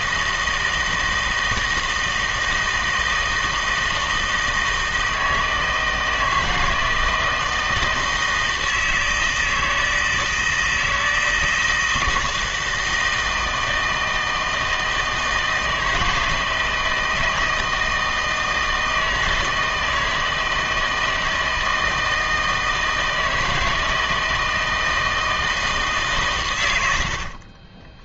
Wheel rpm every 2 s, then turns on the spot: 160, 160, 160, 160, 160, 160, 160, 160, 160, 160, 160, 160, 160, 110.
none